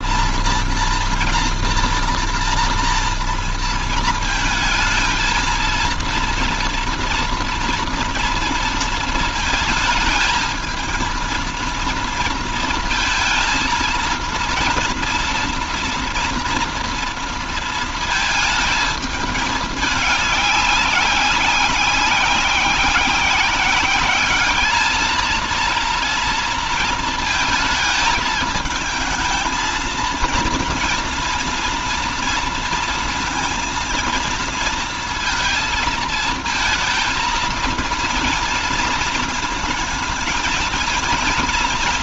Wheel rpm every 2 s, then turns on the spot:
230, 230, 220, 230, 230, 220, 220, 230, 230, 220, 200, 190, 210, 230, 220, 230, 230, 230, 230, 230, 230.
none